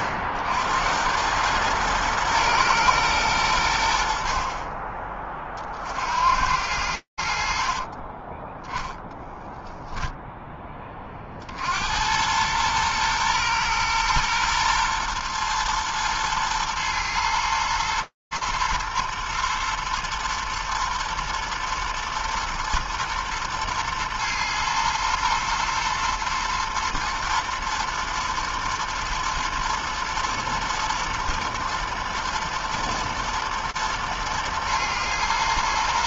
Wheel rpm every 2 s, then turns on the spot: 70, 110, 50, 80, 10, 10, 100, 120, 110, 110, 120, 110, 110, 120, 110, 120, 110, 110.
8-10